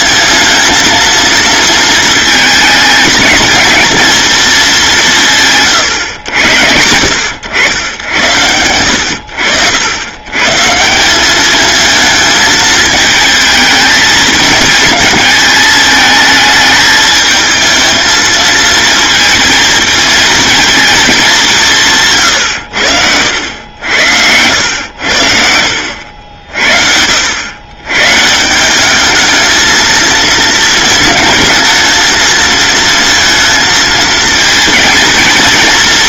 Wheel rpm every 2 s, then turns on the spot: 220, 220, 200, 90, 90, 170, 220, 230, 220, 230, 220, 90, 90, 80, 200, 220, 220, 230.
22-24